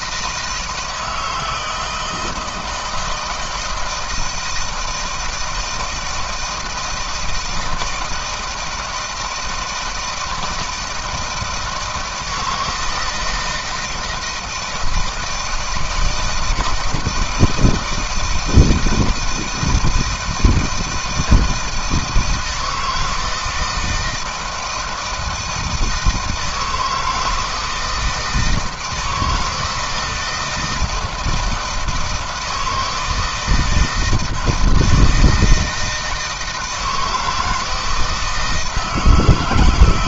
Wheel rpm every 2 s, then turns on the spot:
160, 160, 160, 160, 160, 160, 160, 160, 160, 160, 160, 160, 160, 160, 160, 160, 160, 170, 160, 160.
none